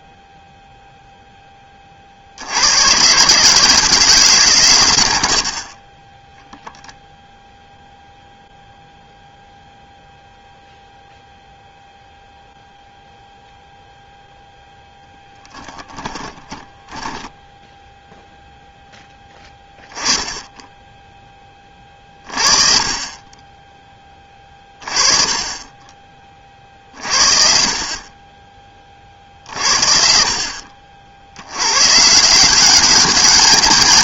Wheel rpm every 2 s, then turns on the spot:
0, 120, 110, 0, 0, 0, 0, 0, 10, 0, 10, 40, 30, 50, 30, 50, 190.
none